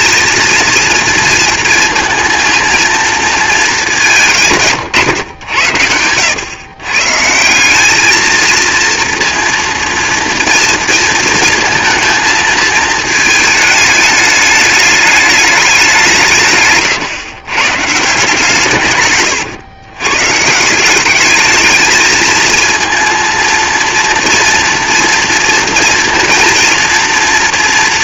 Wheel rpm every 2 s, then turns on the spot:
230, 230, 150, 110, 230, 230, 220, 210, 150, 150, 170, 220, 230, 230.
none